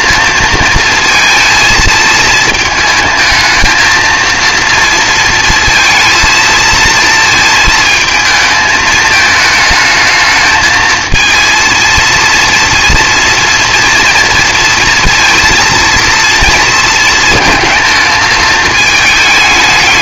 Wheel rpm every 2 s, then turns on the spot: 220, 220, 230, 220, 220, 220, 230, 230, 220, 220.
none